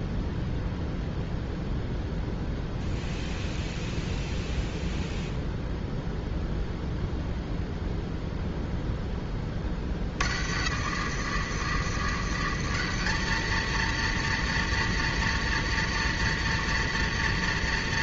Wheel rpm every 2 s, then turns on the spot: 0, 0, 0, 0, 10, 80, 110, 120, 110.
none